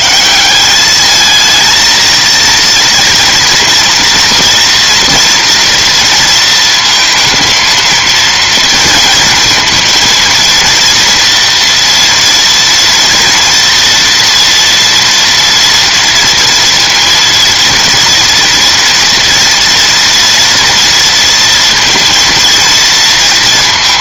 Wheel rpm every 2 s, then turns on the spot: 200, 230, 230, 220, 230, 230, 230, 240, 240, 240, 240, 230.
none